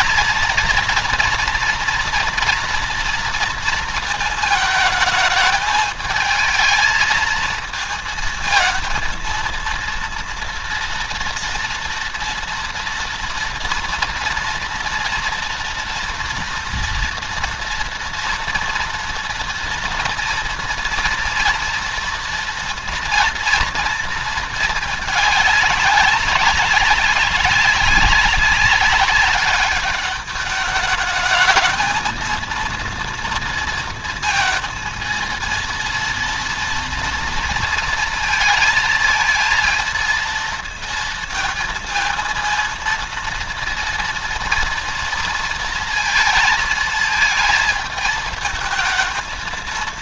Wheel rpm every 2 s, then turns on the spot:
230, 230, 220, 220, 220, 230, 230, 230, 230, 230, 230, 230, 220, 200, 200, 210, 230, 230, 230, 230, 230, 230, 230, 220, 220.
none